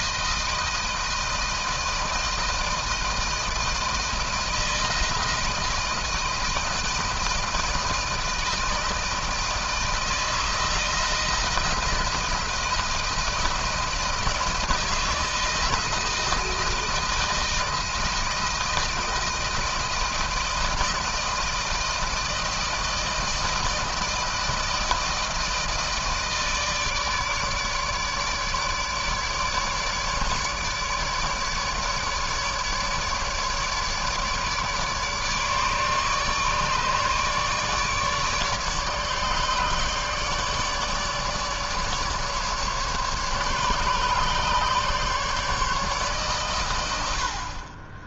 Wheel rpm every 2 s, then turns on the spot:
160, 160, 160, 160, 160, 160, 160, 160, 160, 160, 160, 160, 160, 160, 150, 150, 150, 150, 150, 150, 150, 150, 140, 120.
none